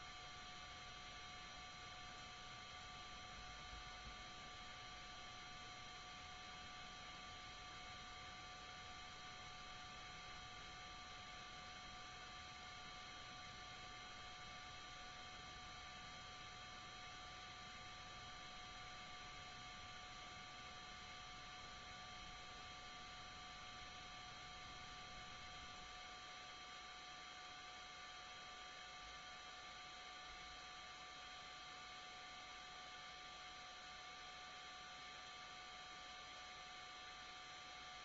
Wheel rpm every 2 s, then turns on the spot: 0, 0, 0, 0, 0, 0, 0, 0, 0, 0, 0, 0, 0, 0, 0, 0, 0, 0, 0.
none